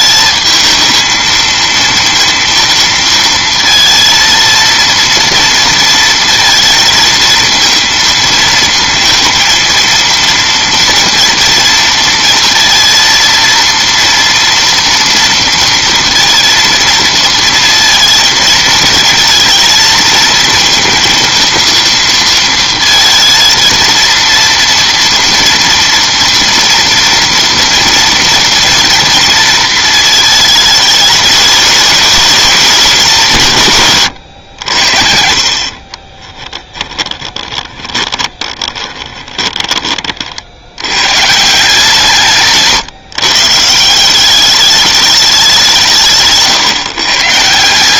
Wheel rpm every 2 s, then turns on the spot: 220, 230, 230, 230, 230, 230, 230, 230, 230, 230, 230, 230, 230, 230, 230, 220, 210, 80, 20, 20, 80, 140, 210, 150.
36-40